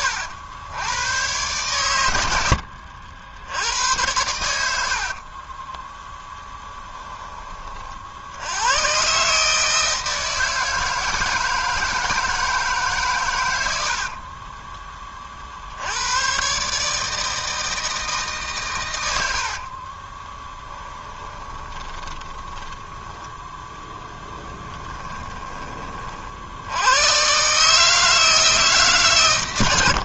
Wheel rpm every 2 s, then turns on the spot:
100, 70, 80, 10, 110, 160, 150, 30, 150, 110, 20, 10, 20, 90, 150.
4-6 20-26